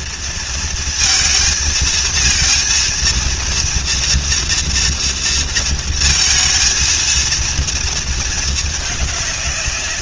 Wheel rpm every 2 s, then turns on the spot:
230, 230, 230, 230, 210.
none